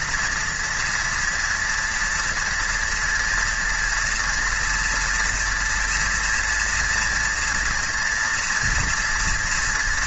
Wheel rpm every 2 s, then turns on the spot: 230, 230, 240, 240, 230.
none